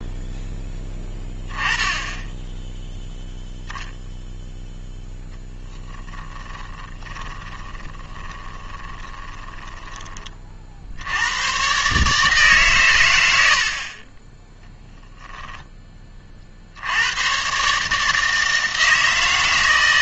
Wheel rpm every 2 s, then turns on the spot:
10, 0, 0, 20, 20, 60, 140, 10, 70, 160.
6-10